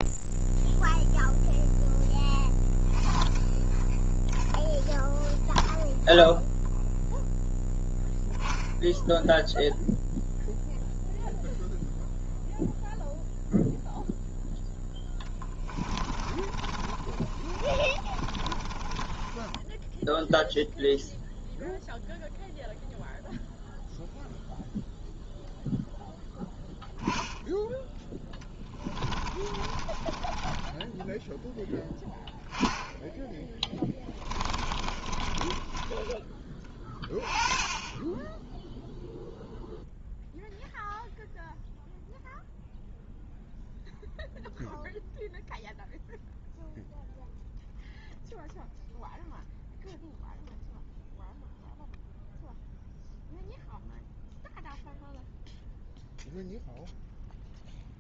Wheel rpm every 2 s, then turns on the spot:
0, 0, 0, 0, 0, 0, 0, 0, 30, 30, 0, 0, 0, 0, 10, 20, 10, 20, 20, 10, 0, 0, 0, 0, 0, 0, 0, 0, 0.
16-20 28-30 34-36